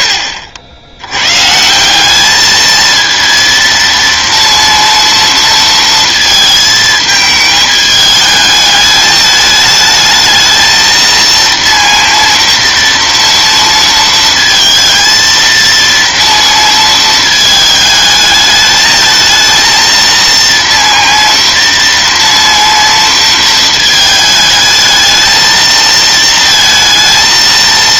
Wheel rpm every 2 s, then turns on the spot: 20, 200, 230, 220, 210, 220, 230, 230, 230, 220, 230, 230, 220, 230.
none